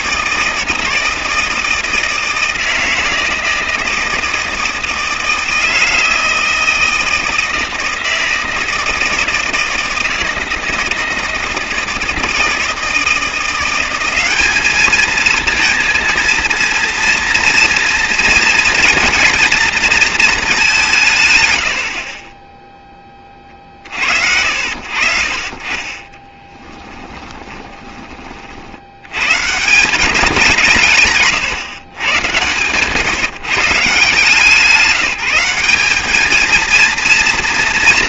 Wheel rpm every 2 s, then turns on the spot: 160, 160, 160, 160, 160, 160, 160, 210, 230, 230, 190, 10, 60, 10, 60, 170, 130, 180, 230.
26-28 32-34